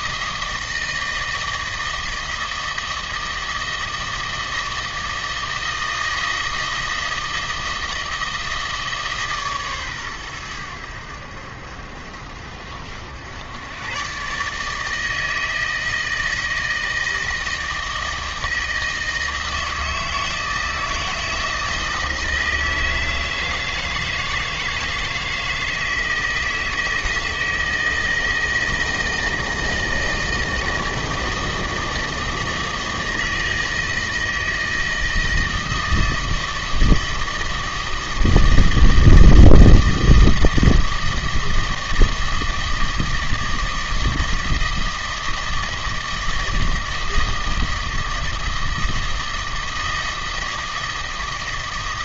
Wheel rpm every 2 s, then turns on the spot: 160, 160, 160, 160, 160, 90, 80, 150, 160, 160, 160, 160, 160, 160, 160, 160, 160, 160, 160, 160, 160, 160, 160, 160, 160, 160.
none